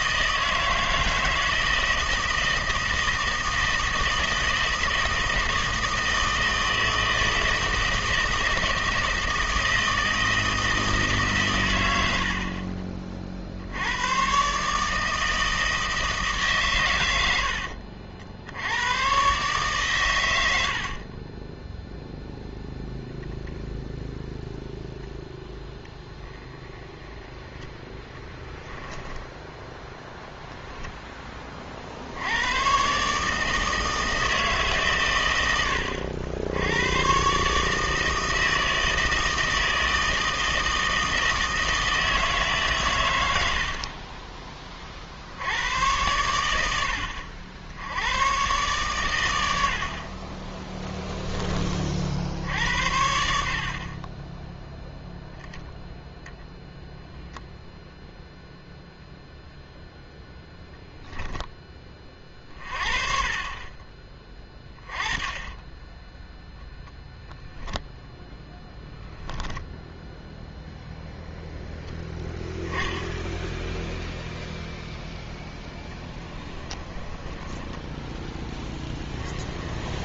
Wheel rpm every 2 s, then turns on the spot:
160, 160, 160, 160, 160, 160, 40, 150, 120, 100, 70, 0, 0, 10, 10, 0, 120, 140, 100, 160, 160, 130, 30, 80, 120, 10, 80, 0, 0, 0, 0, 30, 20, 0, 0, 0, 10, 0, 20, 10.
20-22 28-30 76-80